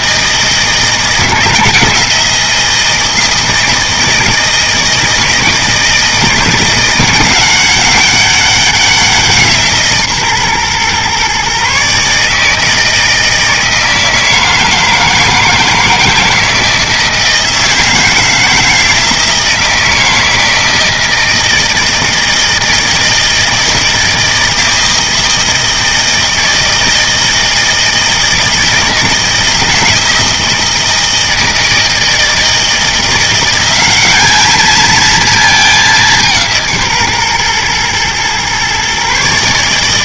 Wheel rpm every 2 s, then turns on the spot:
160, 160, 160, 180, 190, 130, 160, 160, 160, 160, 160, 160, 160, 160, 160, 160, 160, 210, 160, 130.
none